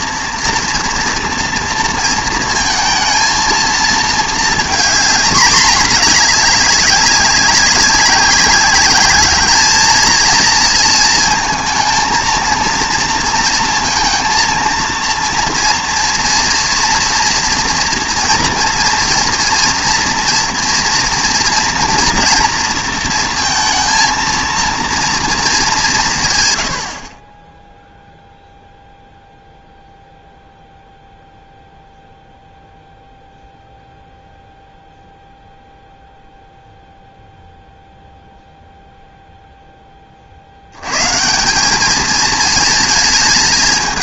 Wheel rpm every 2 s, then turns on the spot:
230, 230, 220, 210, 200, 230, 230, 230, 240, 230, 230, 230, 230, 110, 0, 0, 0, 0, 0, 0, 80, 220.
none